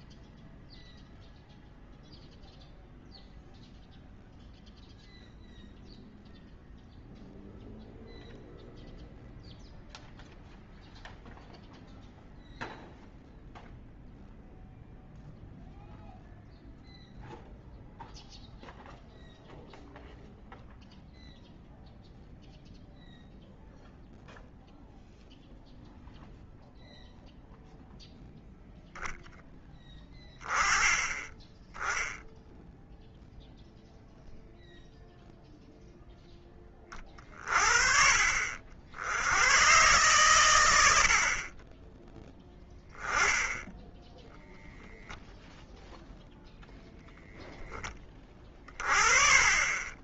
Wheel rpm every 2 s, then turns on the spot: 0, 0, 0, 0, 0, 0, 0, 0, 0, 0, 0, 0, 0, 0, 0, 10, 0, 0, 20, 70, 90, 10, 0, 0, 30.
none